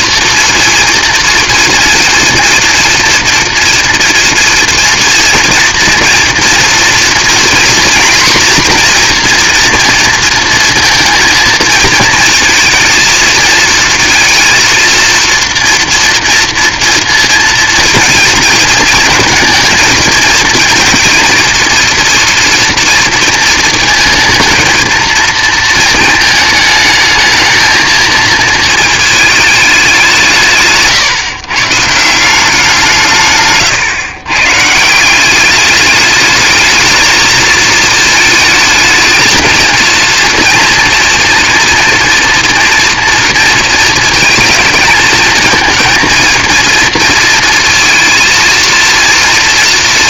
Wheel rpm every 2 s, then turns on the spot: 240, 240, 230, 240, 250, 230, 230, 230, 230, 230, 230, 240, 230, 220, 220, 150, 170, 150, 210, 220, 240, 230, 220, 230, 230.
30-32